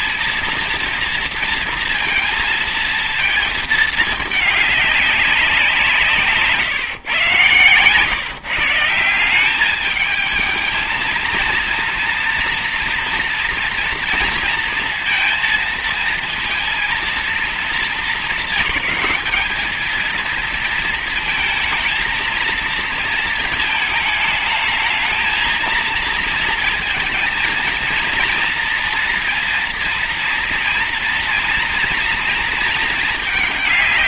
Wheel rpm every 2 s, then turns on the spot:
230, 230, 200, 130, 170, 230, 230, 230, 230, 200, 230, 230, 220, 230, 230, 230, 220.
none